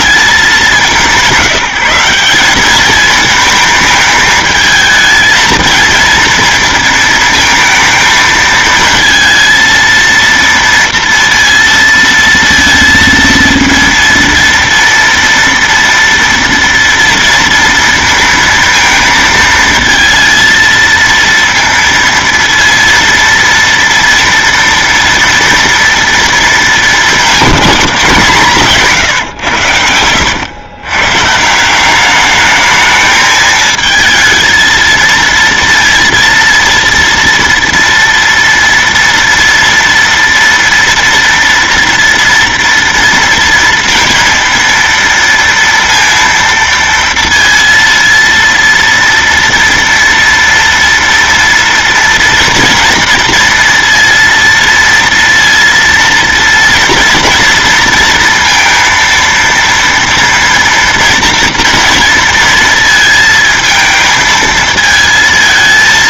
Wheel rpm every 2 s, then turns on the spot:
210, 180, 220, 230, 220, 230, 230, 230, 230, 230, 230, 230, 230, 230, 190, 100, 200, 220, 230, 230, 230, 230, 230, 230, 230, 230, 230, 230, 230, 230, 230, 230, 220.
none